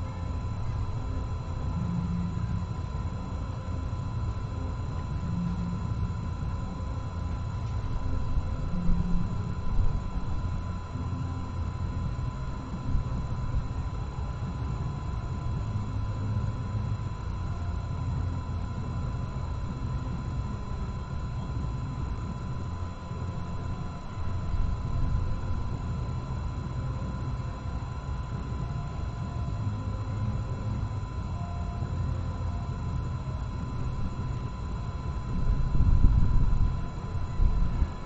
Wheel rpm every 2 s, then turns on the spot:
0, 0, 0, 0, 0, 0, 0, 0, 0, 0, 0, 0, 0, 0, 0, 0, 0, 0, 0.
none